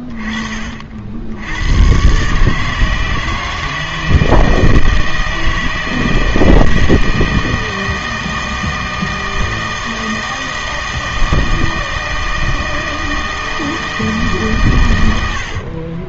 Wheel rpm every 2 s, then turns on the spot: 40, 150, 160, 160, 160, 160, 160, 120.
none